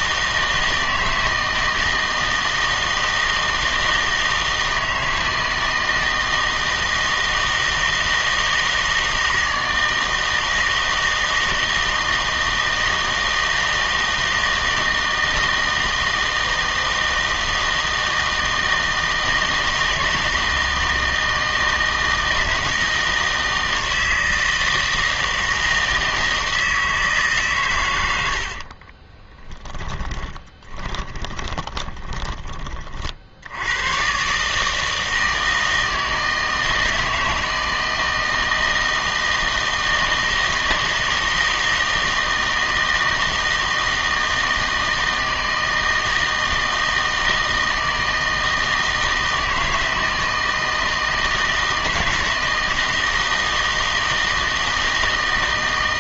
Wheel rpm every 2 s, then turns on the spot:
160, 160, 160, 160, 160, 160, 160, 160, 160, 160, 160, 160, 160, 160, 60, 20, 30, 140, 160, 160, 160, 160, 160, 160, 160, 160, 160, 160.
28-32